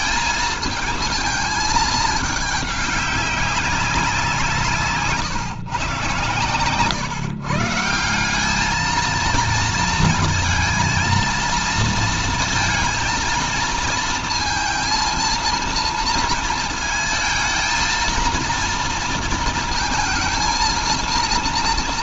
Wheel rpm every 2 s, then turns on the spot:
220, 210, 160, 120, 210, 230, 230, 230, 230, 230, 230.
none